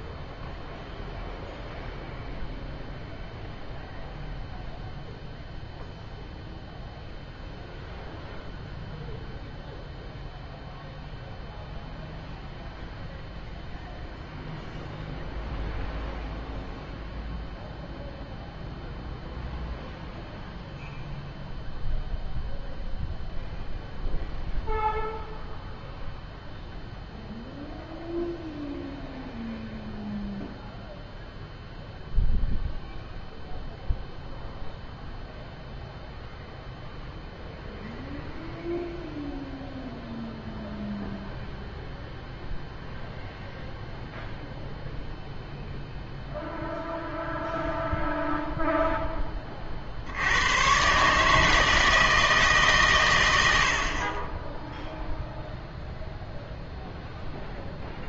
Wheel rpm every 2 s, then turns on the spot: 0, 0, 0, 0, 0, 0, 0, 0, 0, 0, 0, 0, 0, 0, 0, 0, 0, 0, 0, 0, 0, 0, 0, 0, 0, 120, 140, 0, 0.
none